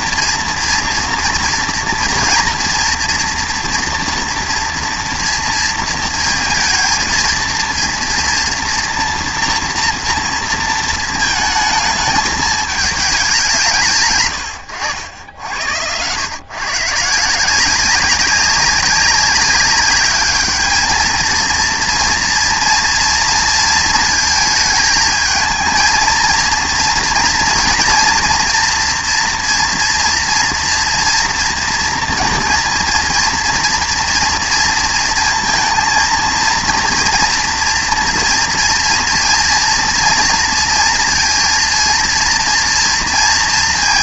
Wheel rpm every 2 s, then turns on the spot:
230, 240, 240, 230, 240, 230, 210, 100, 140, 190, 220, 230, 220, 240, 230, 230, 230, 230, 230, 230, 230, 230.
none